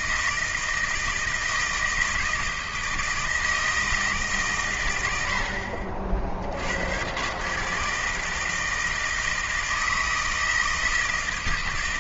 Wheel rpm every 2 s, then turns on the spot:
160, 160, 130, 70, 160, 160.
none